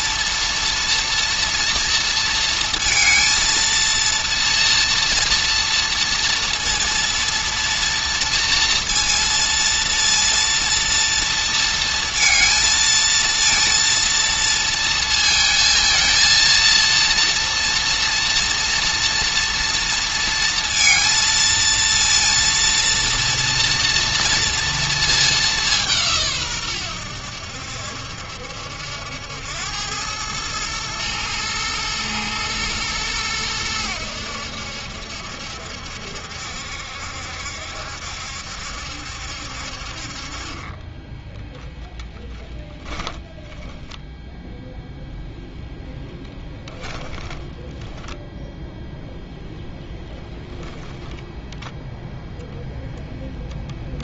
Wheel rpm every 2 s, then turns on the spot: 240, 230, 230, 230, 230, 230, 220, 230, 230, 230, 230, 230, 220, 100, 80, 110, 110, 70, 70, 70, 20, 10, 0, 10, 0, 0, 0.
40-44 46-48